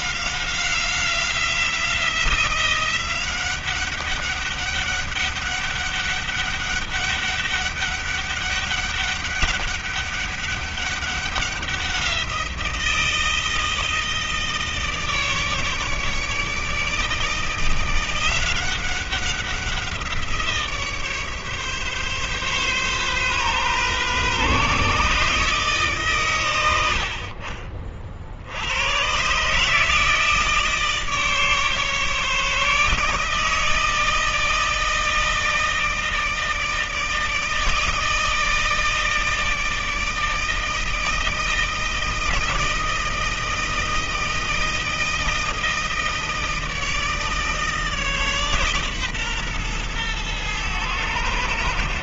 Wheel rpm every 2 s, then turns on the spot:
180, 180, 200, 200, 200, 200, 170, 150, 160, 180, 160, 130, 140, 80, 100, 160, 150, 160, 160, 160, 160, 160, 160, 160, 140, 110.
none